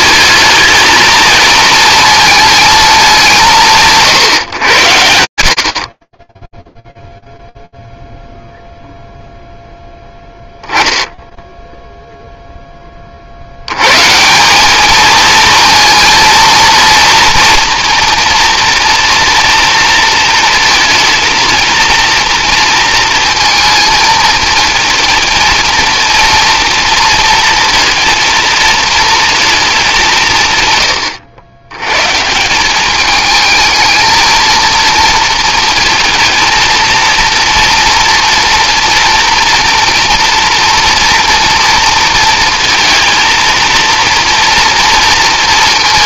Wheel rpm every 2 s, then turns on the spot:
220, 220, 90, 0, 0, 10, 50, 230, 230, 230, 230, 230, 220, 240, 230, 100, 210, 230, 230, 230, 240, 230, 230.
none